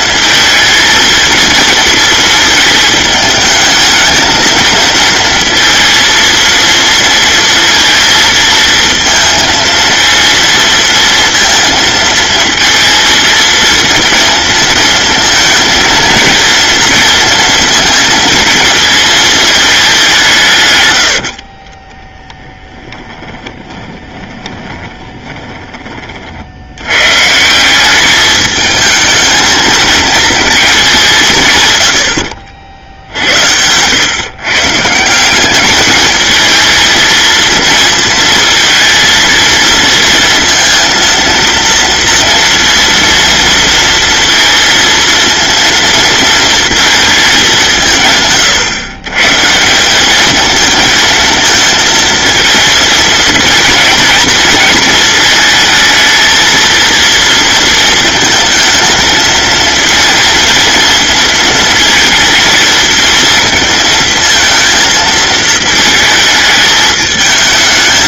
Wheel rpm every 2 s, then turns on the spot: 230, 220, 230, 230, 230, 230, 220, 230, 230, 220, 90, 20, 20, 130, 220, 160, 80, 170, 230, 230, 230, 230, 230, 220, 130, 220, 220, 220, 230, 230, 230, 230, 220, 220.
20-26